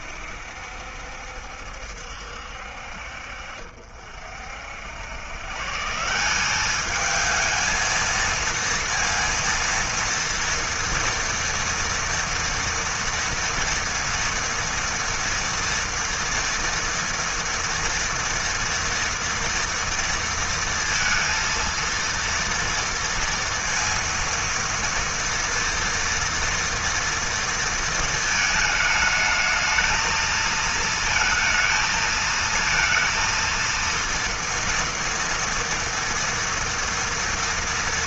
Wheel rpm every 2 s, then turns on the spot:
70, 60, 70, 200, 230, 230, 240, 230, 230, 230, 230, 230, 230, 230, 220, 220, 230, 230, 230.
none